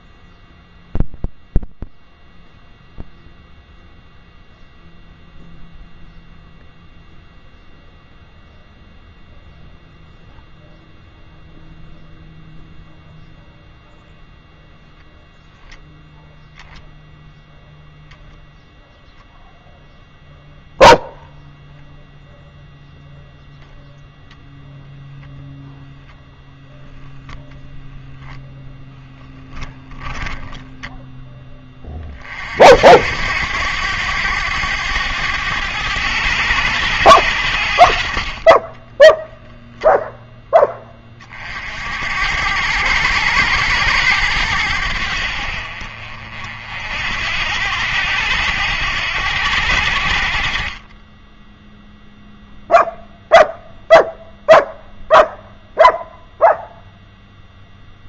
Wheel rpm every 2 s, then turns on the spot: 0, 0, 0, 0, 0, 0, 0, 0, 0, 0, 0, 0, 0, 0, 0, 10, 60, 100, 100, 30, 10, 90, 90, 60, 90, 30, 0, 0, 0.
30-32 38-40